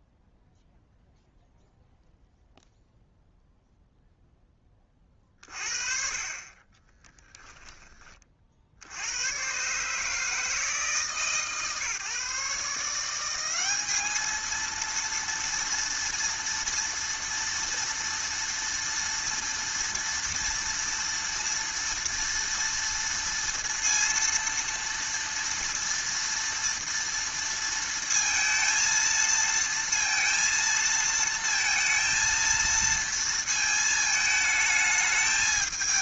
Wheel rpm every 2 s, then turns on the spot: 0, 0, 20, 20, 70, 160, 160, 230, 230, 230, 230, 230, 230, 230, 230, 230, 230, 220.
none